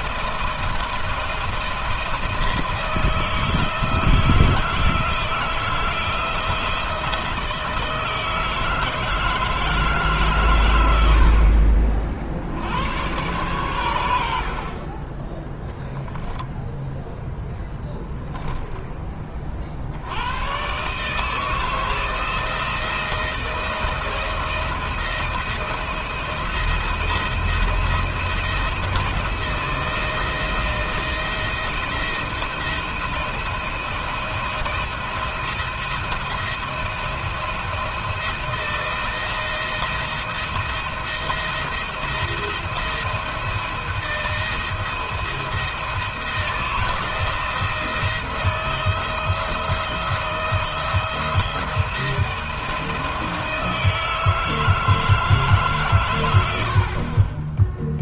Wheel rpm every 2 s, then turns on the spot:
160, 160, 160, 160, 160, 120, 90, 50, 0, 0, 110, 160, 170, 170, 170, 170, 170, 170, 170, 170, 170, 170, 170, 160, 170, 170, 170, 160, 70.
none